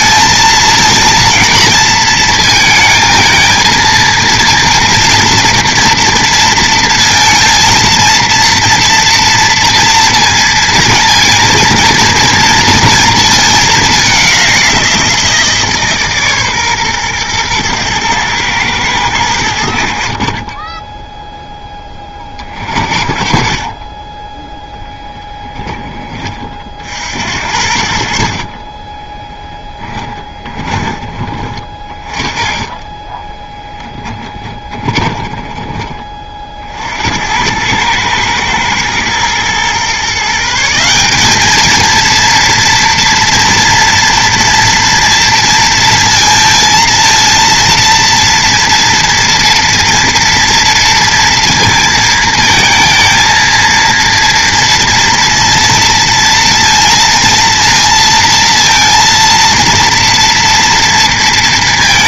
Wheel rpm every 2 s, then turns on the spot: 220, 220, 230, 230, 230, 230, 230, 180, 130, 110, 20, 40, 0, 40, 40, 20, 20, 20, 50, 110, 160, 230, 230, 230, 230, 230, 220, 230, 230, 230, 230.
28-36